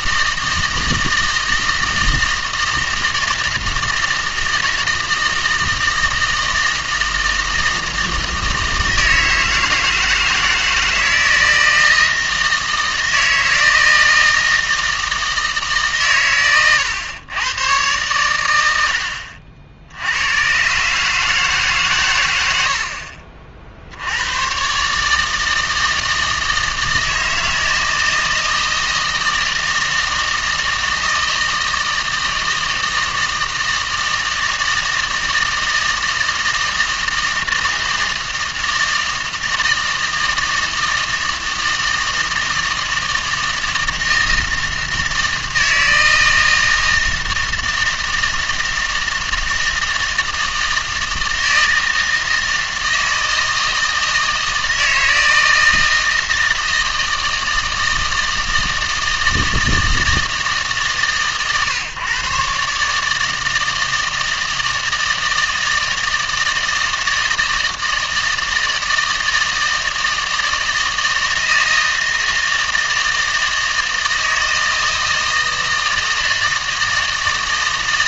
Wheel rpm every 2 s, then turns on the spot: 160, 160, 160, 160, 160, 160, 160, 160, 120, 80, 130, 80, 130, 160, 160, 160, 160, 160, 160, 160, 160, 160, 160, 160, 160, 160, 160, 160, 160, 160, 150, 140, 160, 160, 160, 160, 160, 160, 160.
none